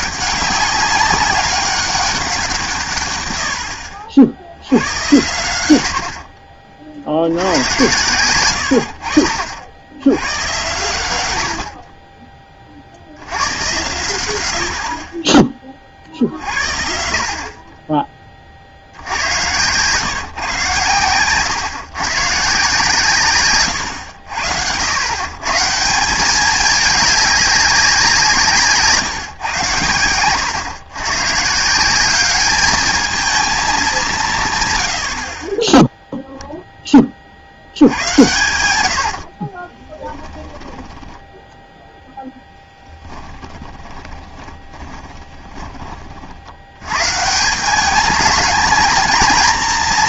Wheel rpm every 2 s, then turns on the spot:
200, 170, 80, 40, 90, 110, 40, 80, 60, 60, 130, 150, 80, 210, 160, 110, 210, 180, 0, 90, 10, 20, 30, 90, 210.
40-46